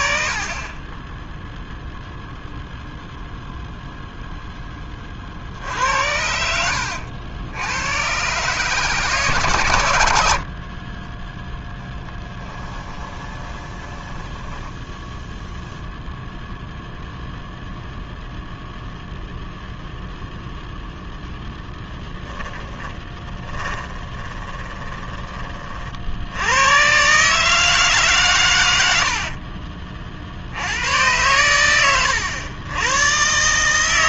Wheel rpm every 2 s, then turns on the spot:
20, 0, 20, 80, 140, 40, 20, 10, 0, 0, 0, 10, 20, 110, 90, 100, 110.
6-8 12-16 22-26